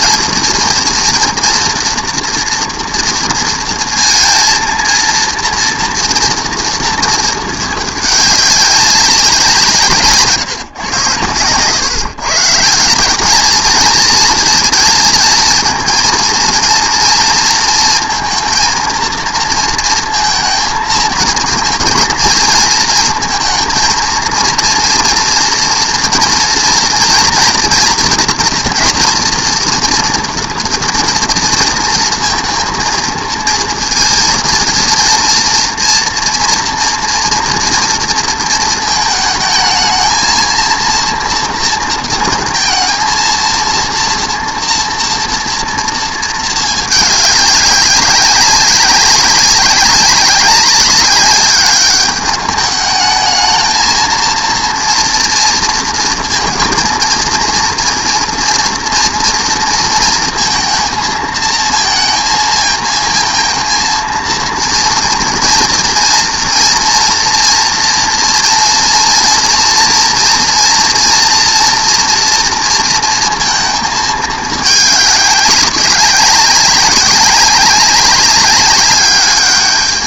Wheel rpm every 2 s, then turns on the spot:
230, 230, 230, 230, 200, 140, 160, 230, 230, 230, 230, 230, 230, 230, 230, 240, 230, 230, 230, 230, 230, 230, 230, 220, 190, 200, 210, 230, 230, 230, 230, 220, 230, 230, 240, 230, 230, 220, 190, 200.
none